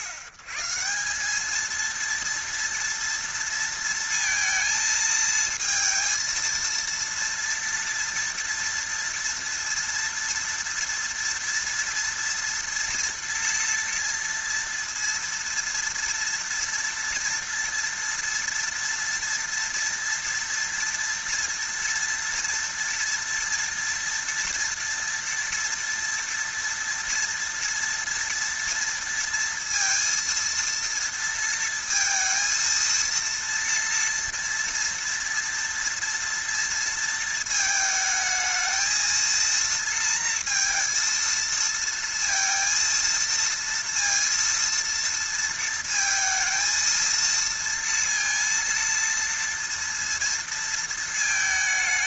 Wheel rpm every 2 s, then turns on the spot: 120, 230, 230, 230, 230, 230, 240, 230, 230, 230, 230, 230, 230, 230, 230, 230, 230, 230, 230, 220, 230, 230, 230, 220, 230, 230.
none